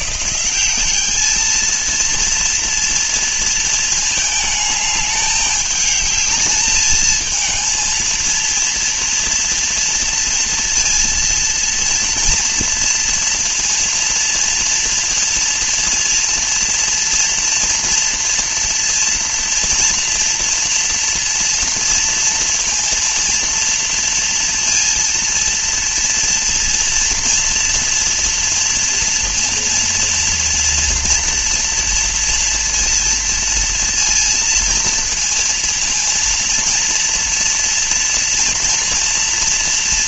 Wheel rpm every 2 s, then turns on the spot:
210, 230, 210, 220, 230, 230, 230, 230, 230, 240, 230, 230, 230, 230, 230, 230, 230, 230, 230, 230.
none